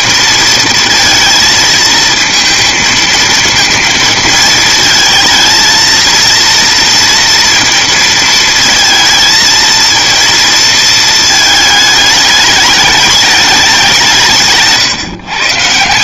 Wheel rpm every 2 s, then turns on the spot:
230, 230, 220, 230, 220, 230, 210, 150.
none